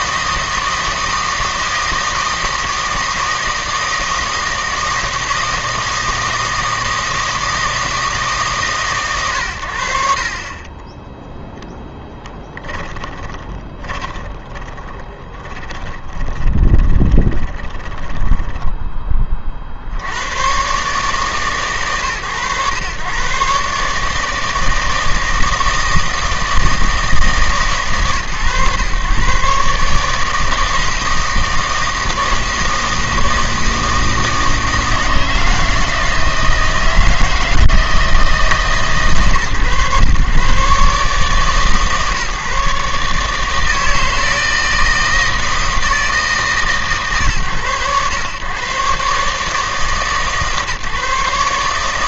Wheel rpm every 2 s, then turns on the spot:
160, 160, 160, 160, 140, 30, 20, 20, 30, 10, 110, 110, 160, 160, 120, 160, 160, 160, 160, 150, 140, 150, 160, 140, 120, 150.
12-20